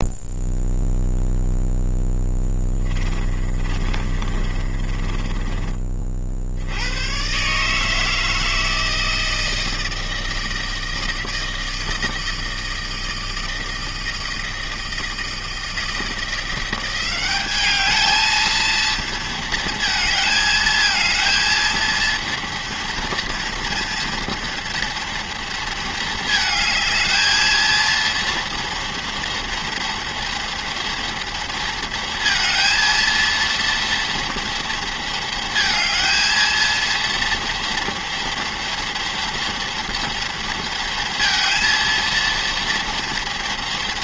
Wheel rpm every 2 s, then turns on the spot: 0, 30, 20, 110, 160, 160, 160, 160, 190, 230, 230, 230, 230, 220, 230, 230, 230, 230, 230, 230, 230, 230.
2-6